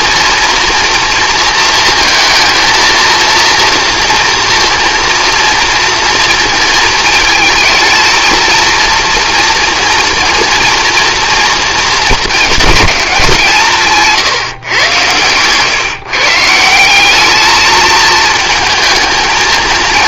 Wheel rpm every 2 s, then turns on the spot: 230, 230, 230, 230, 230, 230, 210, 130, 190, 230.
none